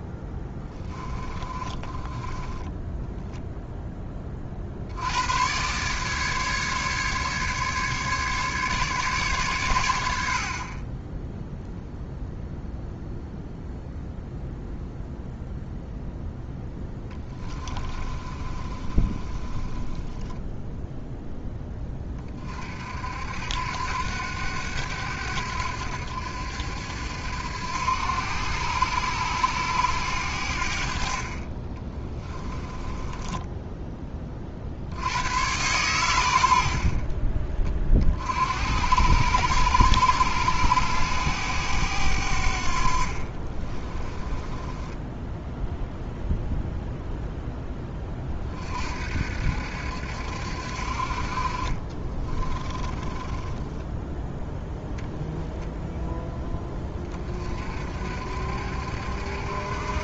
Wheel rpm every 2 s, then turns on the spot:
20, 0, 100, 150, 140, 10, 0, 0, 20, 20, 10, 70, 80, 80, 100, 40, 10, 100, 40, 100, 100, 50, 10, 0, 60, 50, 20, 0, 40, 70.
0-2 16-20 32-34 42-46 52-54